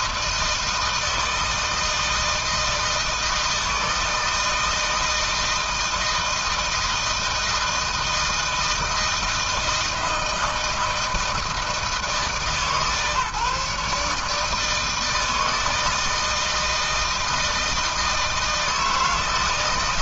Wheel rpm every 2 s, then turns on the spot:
160, 160, 160, 160, 160, 160, 150, 150, 160, 160.
none